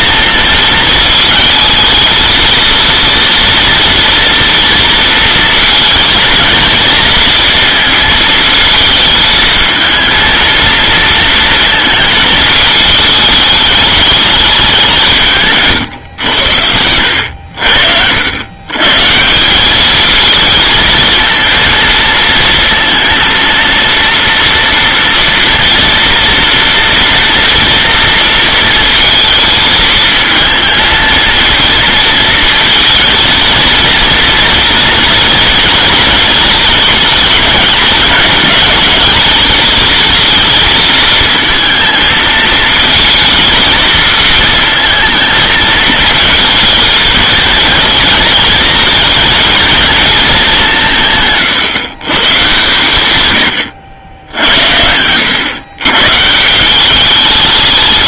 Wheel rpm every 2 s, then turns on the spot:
230, 230, 240, 230, 220, 230, 220, 190, 80, 110, 220, 230, 230, 230, 230, 230, 230, 230, 230, 220, 220, 230, 230, 220, 230, 170, 120, 80, 180.
none